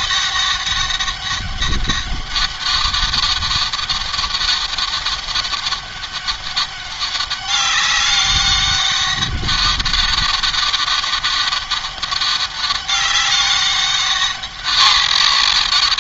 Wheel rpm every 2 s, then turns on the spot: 200, 200, 200, 200, 200, 200, 200, 210.
none